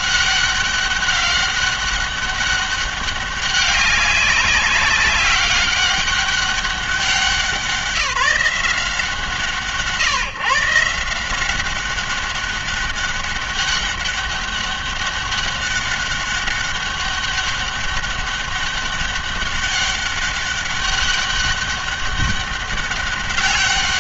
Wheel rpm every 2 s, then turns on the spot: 200, 200, 190, 200, 170, 160, 200, 200, 200, 200, 200, 200.
none